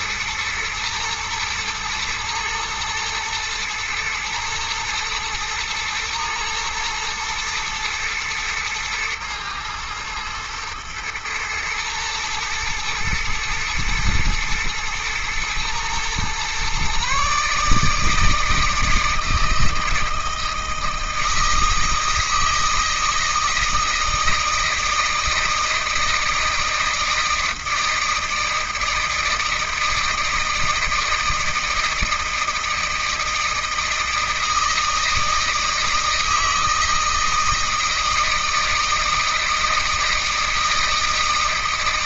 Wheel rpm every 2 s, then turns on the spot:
110, 110, 110, 120, 110, 110, 110, 110, 130, 160, 160, 160, 160, 160, 160, 160, 160, 160, 160, 160, 160.
none